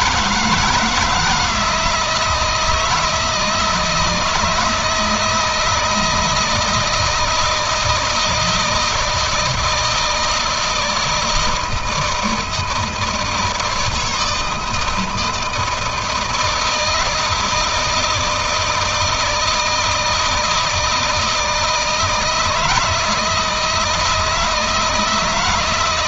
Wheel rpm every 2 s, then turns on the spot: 160, 160, 160, 160, 160, 160, 160, 160, 160, 160, 160, 170, 160.
none